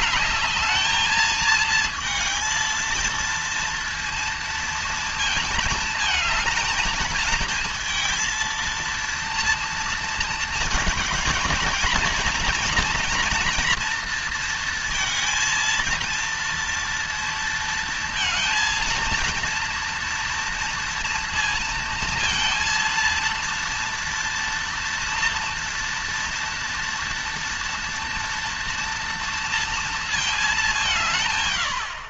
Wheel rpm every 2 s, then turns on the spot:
220, 230, 230, 220, 230, 230, 230, 230, 230, 230, 230, 230, 230, 230, 240, 210.
none